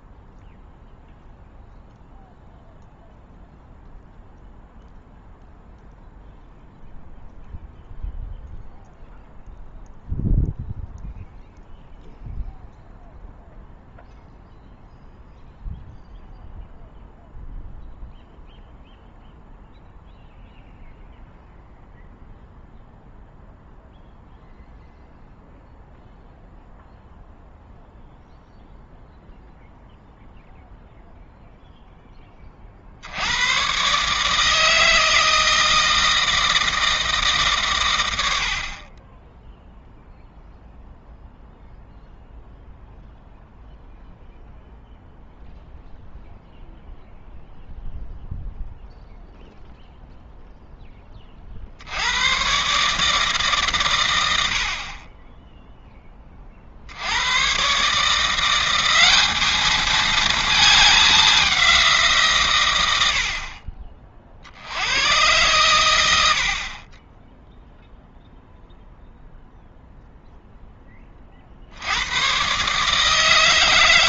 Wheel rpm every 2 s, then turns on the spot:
0, 0, 0, 0, 0, 0, 0, 0, 0, 0, 0, 0, 0, 0, 0, 0, 60, 160, 160, 40, 0, 0, 0, 0, 0, 10, 140, 50, 60, 190, 210, 110, 80, 40, 0, 10, 140.
none